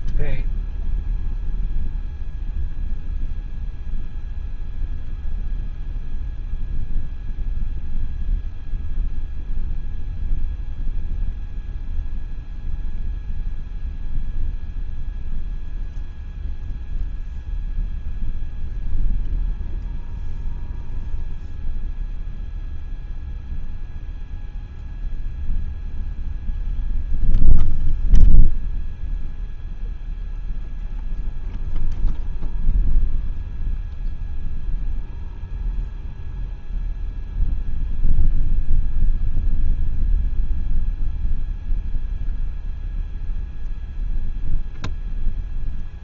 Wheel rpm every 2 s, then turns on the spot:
0, 0, 0, 0, 0, 0, 0, 0, 0, 0, 0, 0, 0, 0, 0, 0, 0, 0, 0, 0, 0, 0, 0.
none